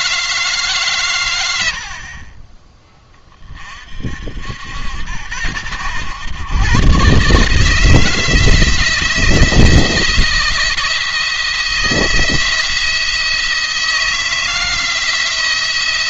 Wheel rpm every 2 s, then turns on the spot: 150, 30, 80, 120, 160, 170, 170, 160.
none